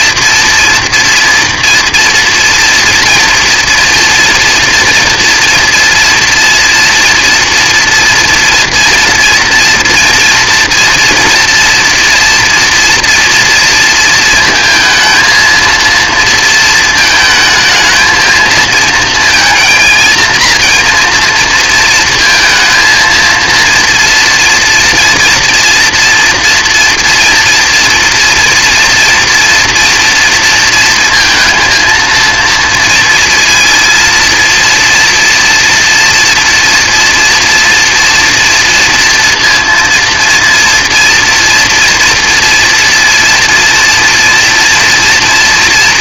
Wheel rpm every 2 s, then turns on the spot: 230, 230, 230, 230, 230, 240, 230, 220, 230, 220, 230, 230, 230, 230, 230, 230, 230, 230, 230, 230, 230, 230, 230.
none